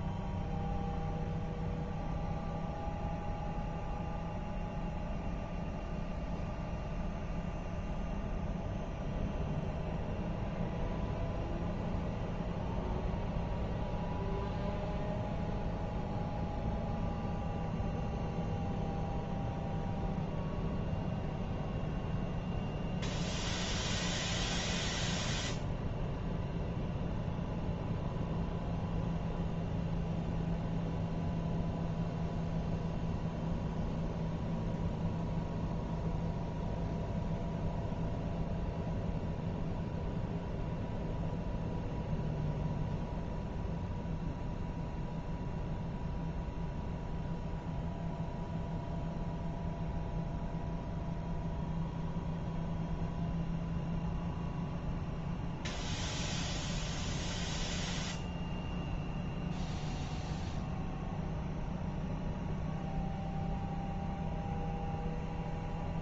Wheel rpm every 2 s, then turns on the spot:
0, 0, 0, 0, 0, 0, 0, 0, 0, 0, 0, 0, 0, 0, 0, 0, 0, 0, 0, 0, 0, 0, 0, 0, 0, 0, 0, 0, 0, 0, 0, 0, 0.
none